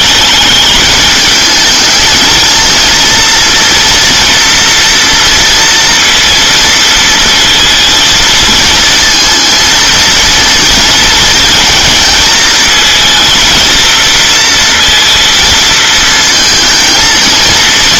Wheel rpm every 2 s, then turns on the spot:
210, 230, 230, 230, 230, 230, 230, 230, 230.
none